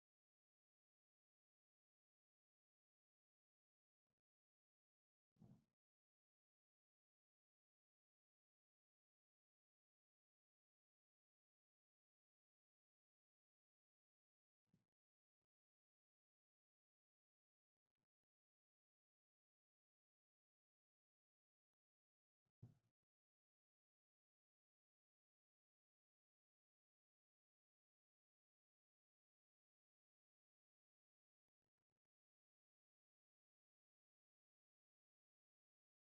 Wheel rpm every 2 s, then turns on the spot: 0, 0, 0, 0, 0, 0, 0, 0, 0, 0, 0, 0, 0, 0, 0, 0, 0, 0.
none